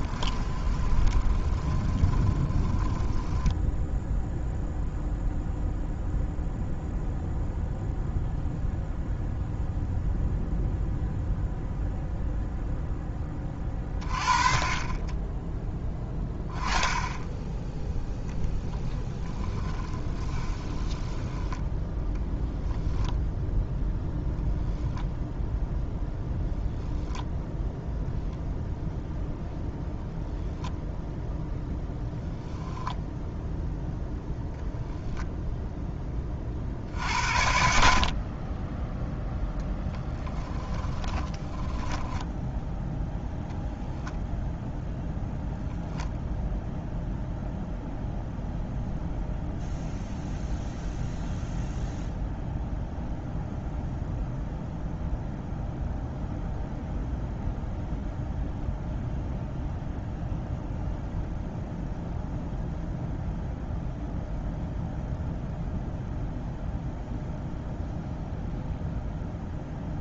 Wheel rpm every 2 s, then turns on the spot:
20, 10, 0, 0, 0, 0, 0, 30, 10, 0, 20, 0, 0, 10, 0, 0, 0, 0, 50, 10, 20, 0, 0, 0, 0, 0, 0, 0, 0, 0, 0, 0, 0, 0, 0.
0-4 20-22 26-28 40-42